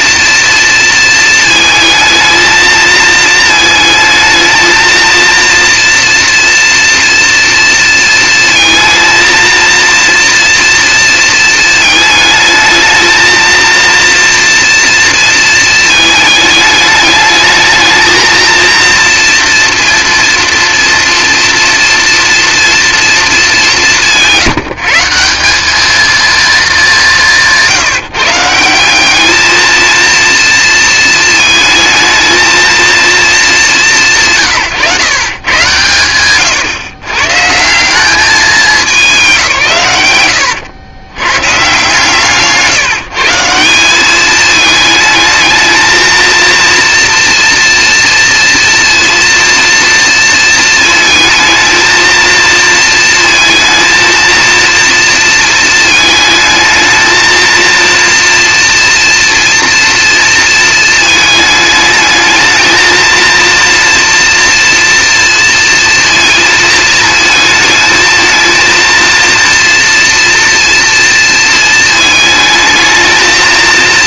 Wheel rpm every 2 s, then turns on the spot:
230, 230, 230, 230, 230, 230, 220, 230, 210, 230, 230, 230, 160, 210, 190, 230, 230, 150, 120, 190, 90, 150, 220, 230, 230, 230, 230, 230, 220, 230, 220, 220, 230, 230, 230, 230, 220.
none